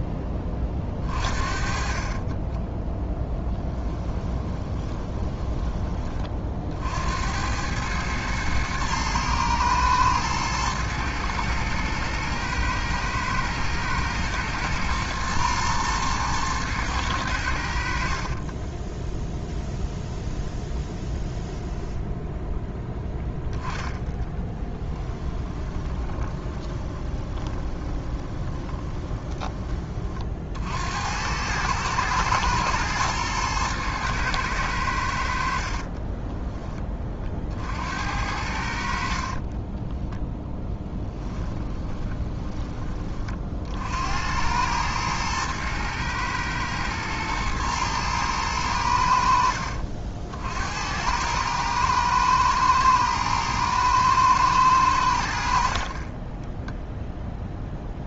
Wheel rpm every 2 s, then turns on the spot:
20, 10, 20, 60, 110, 110, 110, 110, 110, 20, 0, 10, 20, 20, 20, 70, 110, 90, 20, 70, 10, 20, 110, 110, 90, 80, 110, 90, 0.
2-6 18-20 24-30 40-42